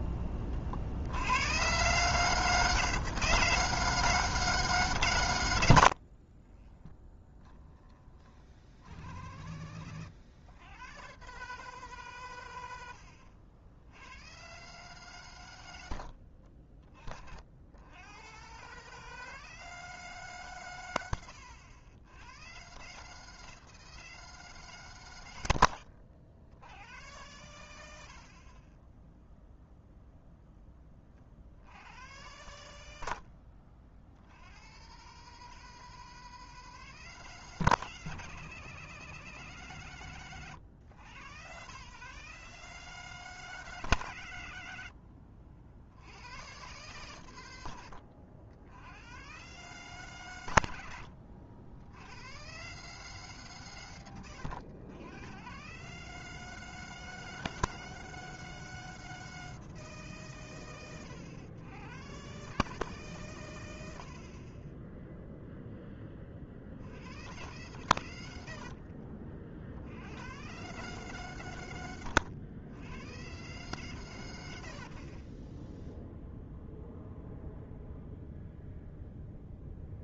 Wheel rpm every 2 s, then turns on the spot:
40, 160, 150, 20, 70, 120, 100, 130, 50, 140, 110, 140, 140, 100, 20, 20, 90, 130, 160, 160, 100, 150, 80, 120, 80, 100, 140, 100, 160, 160, 90, 150, 10, 70, 60, 150, 100, 50, 0, 0.
6-8 68-70